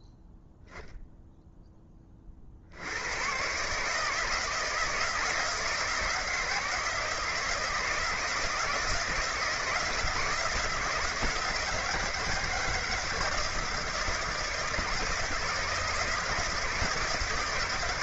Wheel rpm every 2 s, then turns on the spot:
0, 80, 160, 160, 160, 160, 160, 160, 160.
none